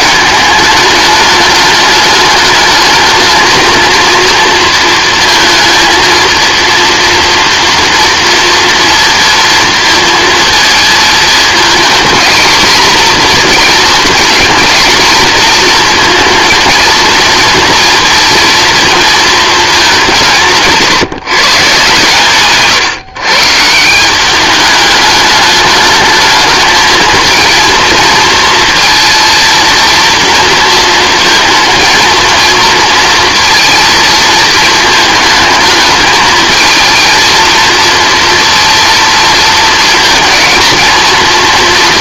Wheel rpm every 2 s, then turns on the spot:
210, 210, 230, 230, 230, 220, 240, 220, 230, 230, 160, 140, 210, 220, 230, 230, 230, 220, 220, 230, 220.
none